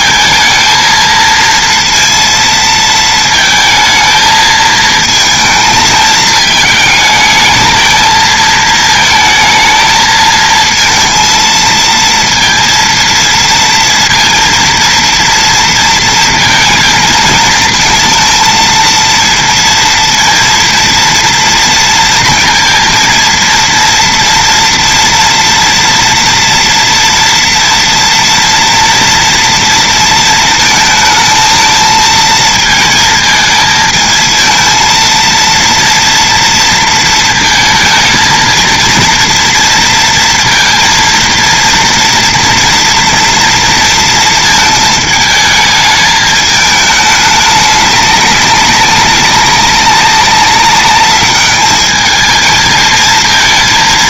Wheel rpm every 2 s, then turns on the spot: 230, 230, 220, 220, 220, 230, 230, 230, 220, 230, 230, 230, 230, 230, 240, 220, 220, 230, 230, 230, 230, 240, 220, 210, 200, 200, 220.
none